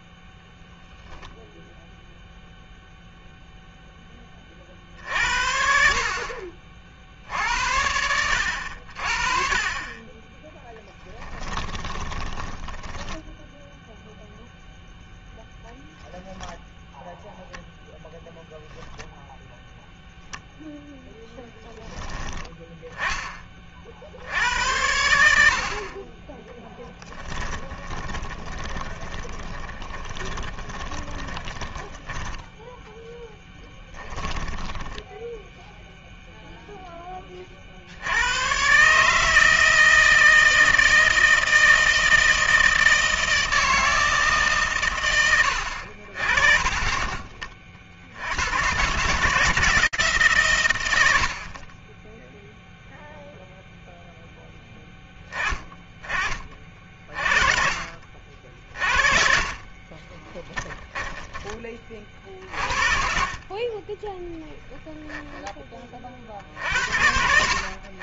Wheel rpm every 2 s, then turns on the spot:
10, 0, 70, 60, 40, 10, 10, 0, 0, 10, 0, 10, 80, 10, 20, 30, 10, 10, 10, 140, 160, 160, 100, 40, 150, 60, 0, 10, 40, 40, 10, 50, 10, 70.
10-12 26-32 58-62